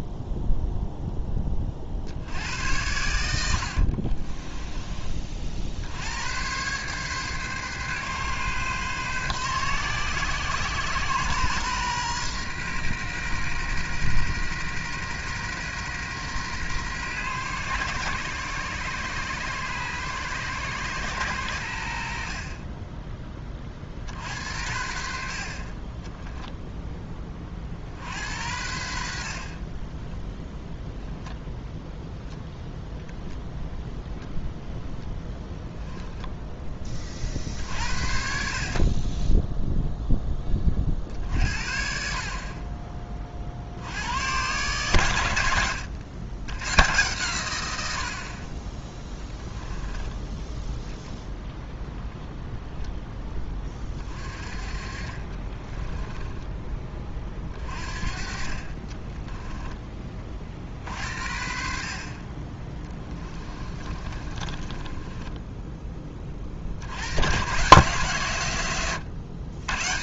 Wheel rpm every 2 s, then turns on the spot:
0, 100, 20, 120, 130, 120, 120, 120, 130, 120, 120, 40, 70, 0, 80, 0, 0, 0, 10, 40, 30, 40, 120, 110, 30, 0, 0, 30, 10, 30, 60, 20, 20, 50, 110.
4-6 54-56 64-66